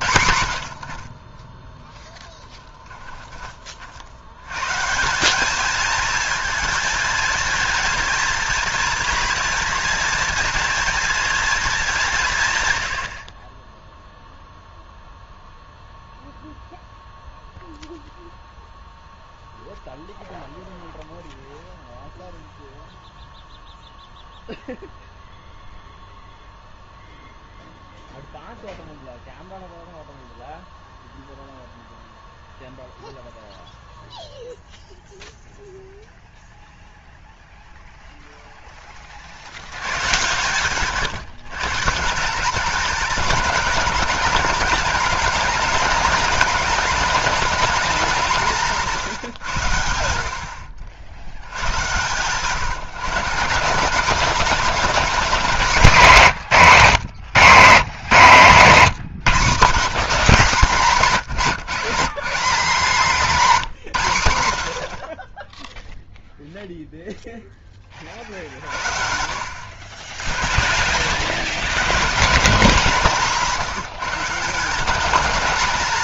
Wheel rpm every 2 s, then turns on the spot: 80, 10, 120, 220, 230, 230, 130, 0, 0, 0, 0, 0, 0, 0, 0, 0, 0, 0, 0, 0, 140, 200, 230, 230, 180, 70, 150, 210, 170, 170, 170, 190, 80, 0, 60, 70, 170, 190.
none